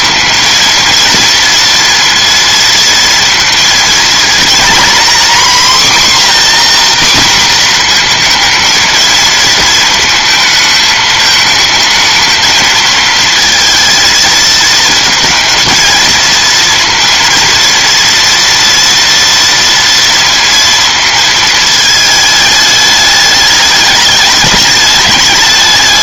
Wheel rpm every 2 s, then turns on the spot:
230, 230, 240, 250, 230, 220, 220, 230, 230, 230, 230, 210, 200.
none